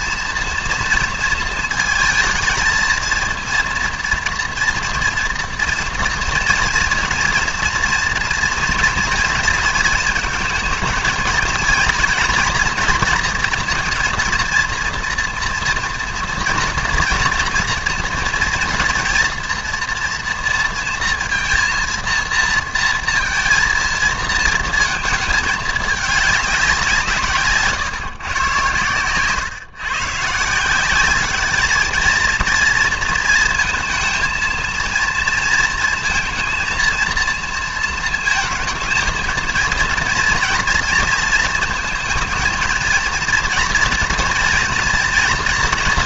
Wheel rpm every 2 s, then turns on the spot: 230, 220, 230, 230, 230, 220, 240, 230, 230, 230, 230, 230, 220, 200, 120, 170, 230, 230, 230, 220, 230, 220, 230.
none